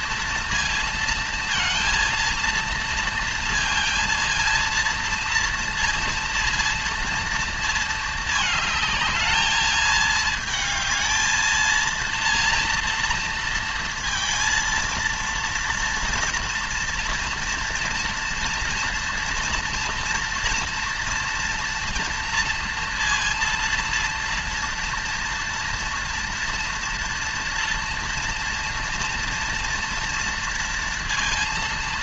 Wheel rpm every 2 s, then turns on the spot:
230, 230, 230, 230, 220, 220, 230, 230, 230, 230, 230, 230, 230, 230, 230, 230.
none